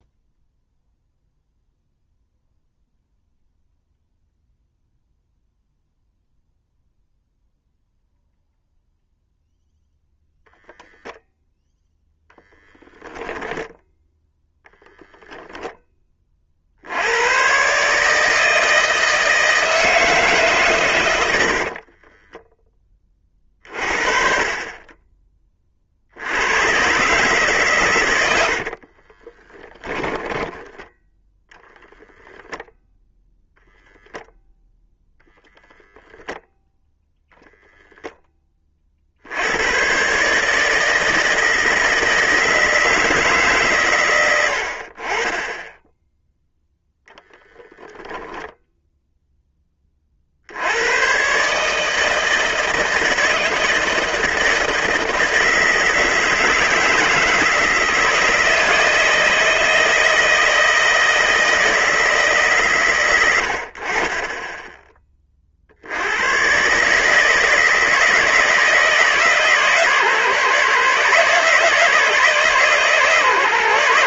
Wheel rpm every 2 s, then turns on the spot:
0, 0, 0, 0, 0, 0, 0, 0, 60, 160, 130, 30, 30, 110, 60, 10, 0, 0, 0, 40, 160, 160, 70, 0, 0, 100, 160, 160, 160, 160, 160, 130, 20, 130, 160, 150, 150.
22-24 28-32